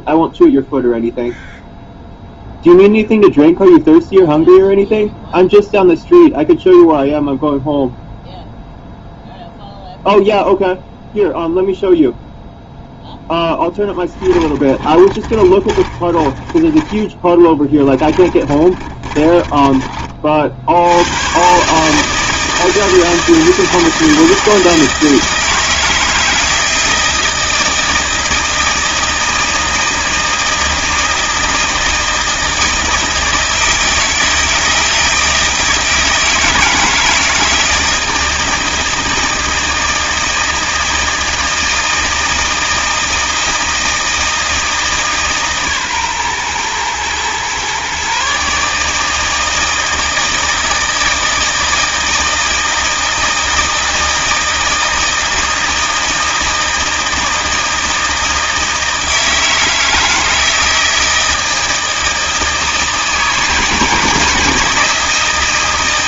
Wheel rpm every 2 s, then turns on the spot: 0, 0, 0, 0, 0, 0, 0, 20, 30, 30, 70, 160, 160, 160, 160, 160, 160, 160, 160, 160, 160, 160, 160, 120, 150, 160, 160, 160, 160, 160, 160, 160, 160.
14-16 18-20